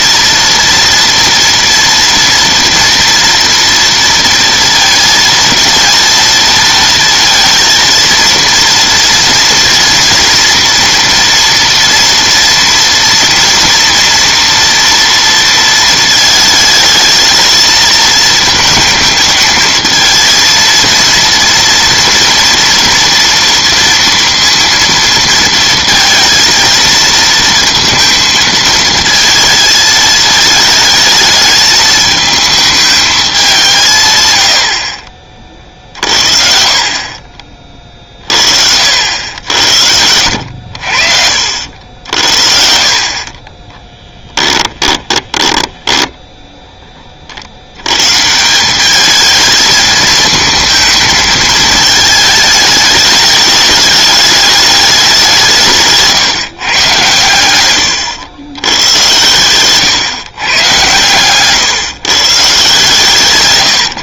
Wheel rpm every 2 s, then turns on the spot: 230, 230, 230, 230, 230, 230, 230, 230, 220, 220, 230, 230, 230, 230, 230, 220, 220, 60, 50, 60, 80, 60, 10, 10, 180, 220, 210, 210, 120, 110, 120, 140.
42-46